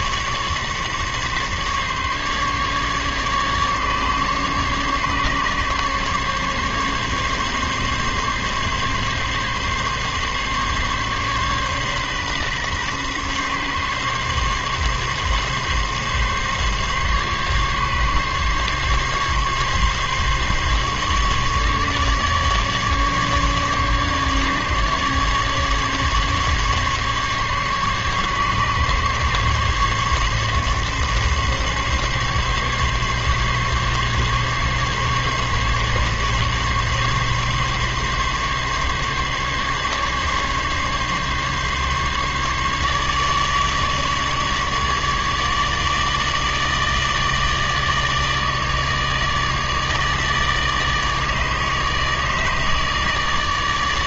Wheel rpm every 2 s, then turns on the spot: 150, 140, 140, 140, 140, 140, 140, 140, 140, 140, 140, 150, 150, 140, 140, 140, 140, 140, 140, 140, 140, 150, 150, 150, 150, 150, 150.
none